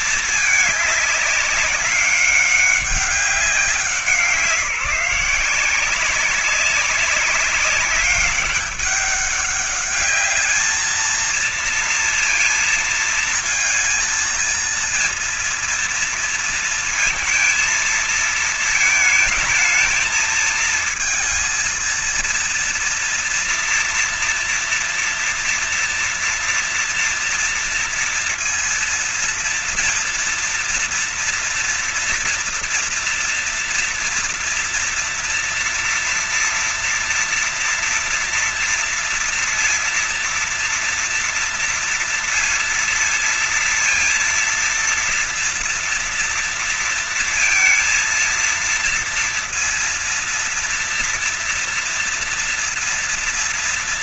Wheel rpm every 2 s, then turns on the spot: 220, 190, 170, 190, 200, 210, 230, 230, 230, 220, 220, 230, 230, 230, 230, 230, 230, 230, 240, 240, 230, 230, 230, 230, 230, 230, 230.
none